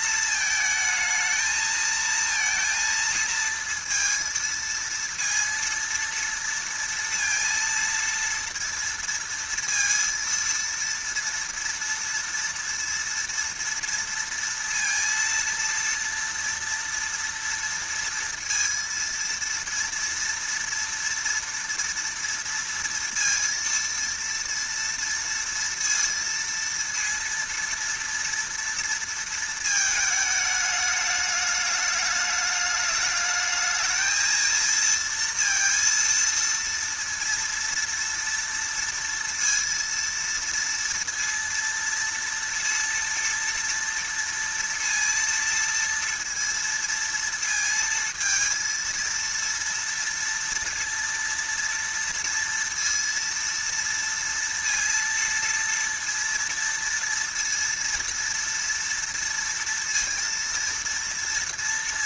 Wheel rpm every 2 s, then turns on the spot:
220, 230, 230, 230, 230, 230, 230, 230, 230, 230, 230, 230, 230, 230, 230, 210, 210, 230, 230, 230, 230, 230, 230, 230, 230, 230, 230, 230, 230, 240, 230.
none